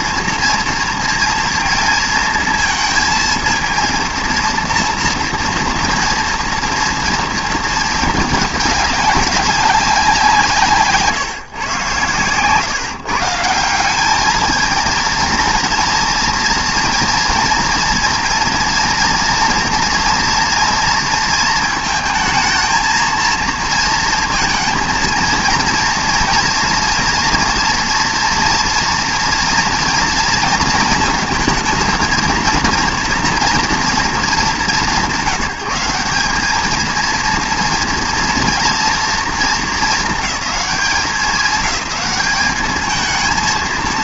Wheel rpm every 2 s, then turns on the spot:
230, 230, 230, 230, 200, 150, 140, 230, 230, 240, 230, 220, 230, 240, 230, 230, 230, 180, 220, 230, 210, 220.
none